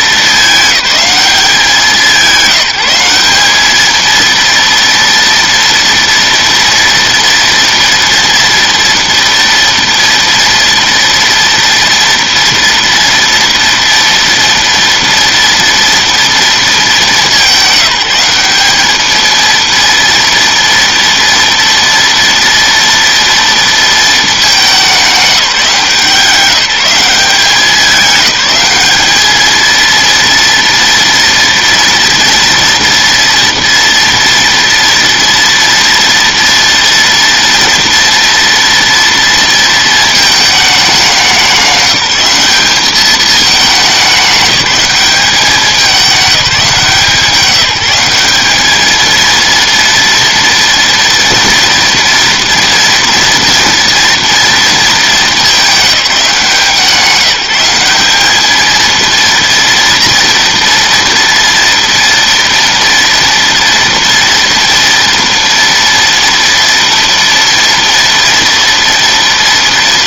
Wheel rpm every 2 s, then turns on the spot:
200, 180, 230, 240, 230, 230, 230, 230, 210, 210, 230, 230, 190, 190, 210, 230, 230, 230, 230, 230, 200, 210, 200, 170, 220, 230, 230, 220, 180, 230, 240, 230, 230, 230, 240.
none